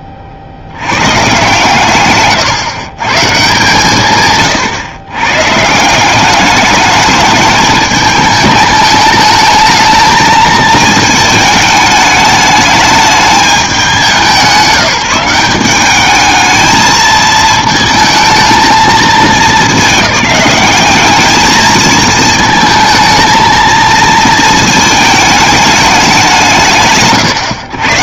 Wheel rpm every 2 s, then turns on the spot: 50, 110, 140, 210, 220, 220, 210, 170, 220, 220, 200, 220, 220, 150.
none